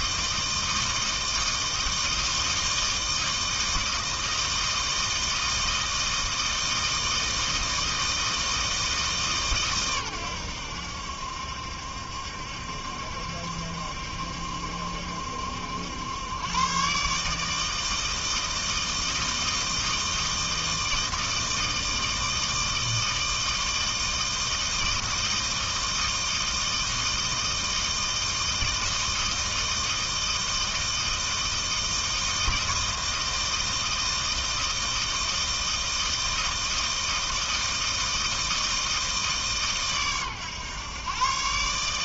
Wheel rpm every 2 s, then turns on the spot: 160, 160, 160, 160, 160, 90, 70, 70, 120, 160, 160, 160, 160, 160, 160, 160, 160, 160, 160, 160, 120.
none